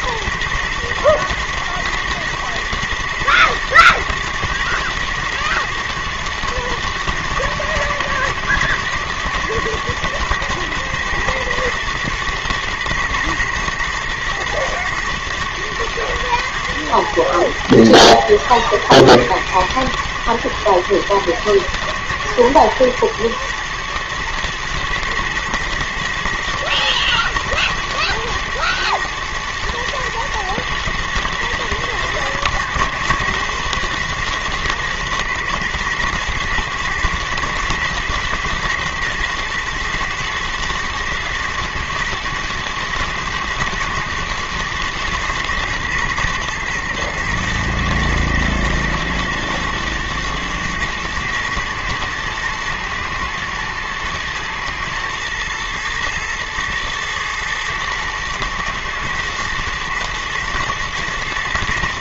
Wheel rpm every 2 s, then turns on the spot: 110, 120, 110, 120, 110, 110, 110, 120, 110, 110, 110, 110, 120, 120, 110, 120, 120, 120, 120, 120, 110, 120, 110, 110, 120, 120, 120, 120, 110, 110, 120.
none